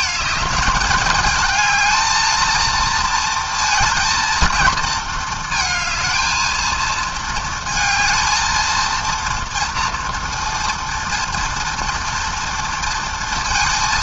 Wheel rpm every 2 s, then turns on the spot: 210, 230, 230, 220, 230, 240, 230.
none